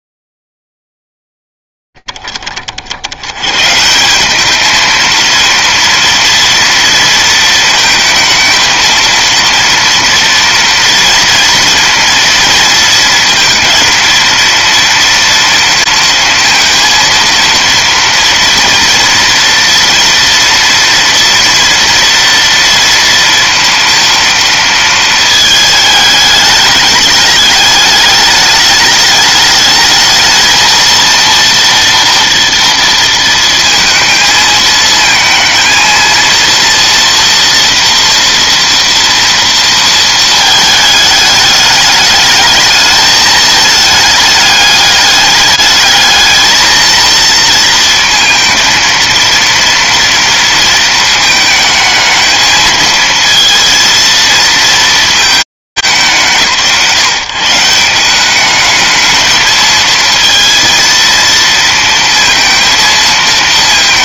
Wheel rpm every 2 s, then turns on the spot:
20, 10, 140, 230, 230, 230, 230, 230, 230, 230, 230, 230, 230, 220, 210, 220, 240, 230, 230, 230, 230, 210, 210, 210, 230, 230, 220, 230, 160, 180, 220, 230.
none